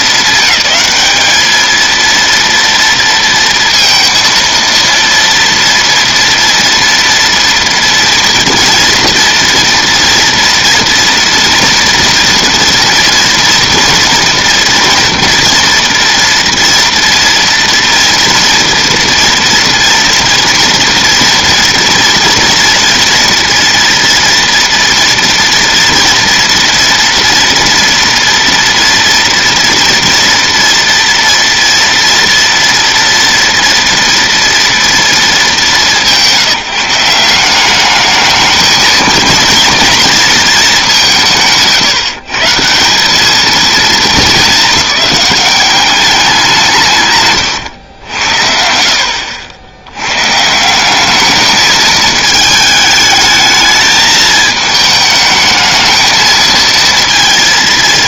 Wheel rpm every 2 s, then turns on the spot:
210, 230, 230, 230, 230, 230, 230, 230, 230, 230, 230, 240, 240, 230, 230, 230, 230, 230, 170, 220, 210, 160, 210, 160, 60, 190, 210, 220, 230.
none